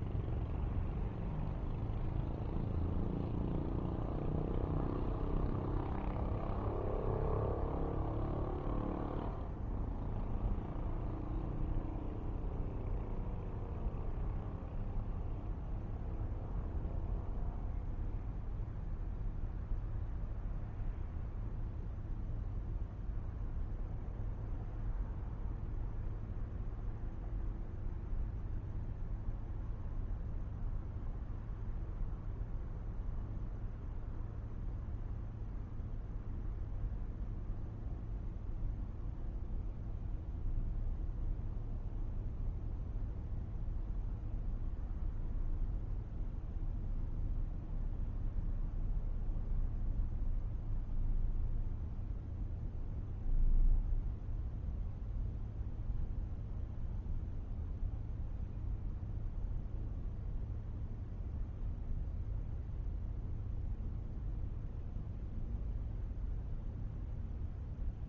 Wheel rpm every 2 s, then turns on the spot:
0, 0, 0, 0, 0, 0, 0, 0, 0, 0, 0, 0, 0, 0, 0, 0, 0, 0, 0, 0, 0, 0, 0, 0, 0, 0, 0, 0, 0, 0, 0, 0, 0, 0.
none